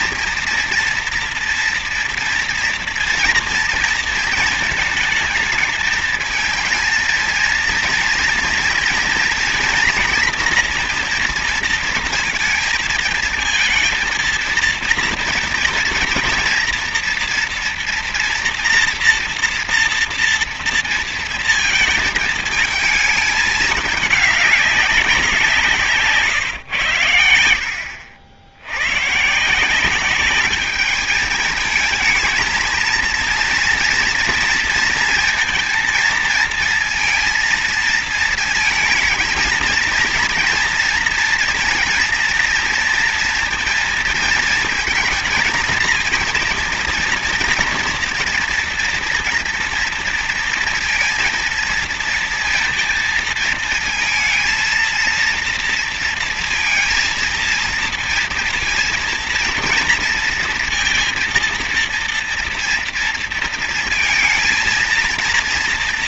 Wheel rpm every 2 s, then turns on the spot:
230, 230, 230, 220, 230, 230, 220, 230, 230, 240, 230, 220, 200, 120, 90, 210, 230, 230, 230, 230, 230, 230, 230, 230, 240, 230, 230, 230, 230, 230, 230, 230, 230.
none